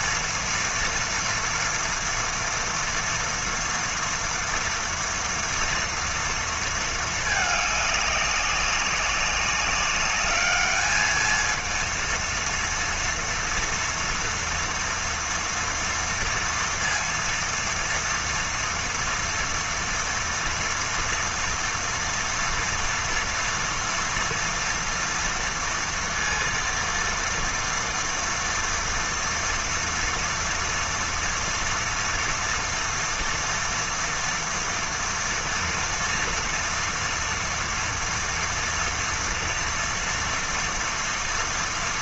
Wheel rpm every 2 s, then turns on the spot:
230, 240, 230, 220, 190, 220, 230, 240, 230, 230, 230, 230, 230, 230, 230, 230, 230, 230, 230, 230, 230.
none